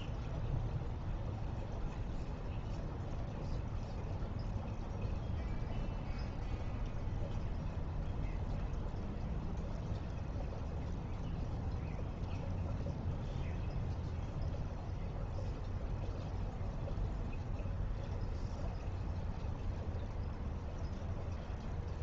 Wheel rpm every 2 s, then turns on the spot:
0, 0, 0, 0, 0, 0, 0, 0, 0, 0, 0.
none